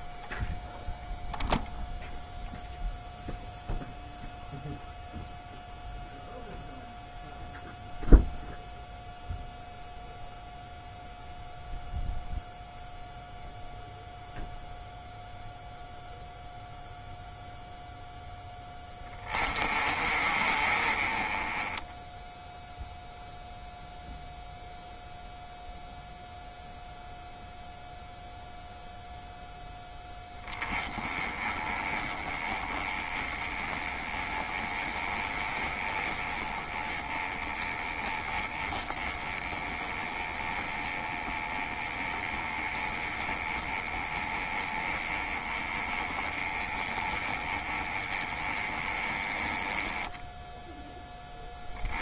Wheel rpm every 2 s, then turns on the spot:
0, 0, 0, 0, 0, 0, 0, 0, 0, 10, 30, 0, 0, 0, 0, 20, 20, 20, 20, 20, 20, 20, 20, 20, 20, 0.
none